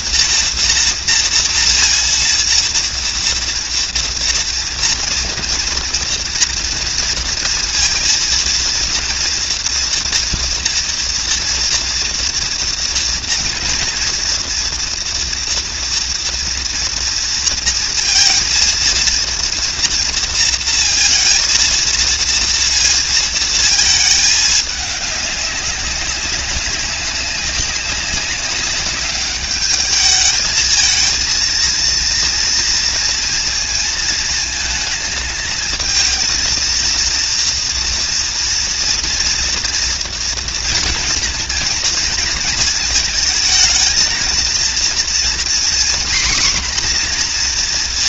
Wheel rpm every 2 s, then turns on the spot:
230, 240, 230, 230, 230, 230, 230, 230, 230, 230, 230, 230, 210, 200, 200, 220, 230, 220, 230, 240, 230, 220, 240, 250.
none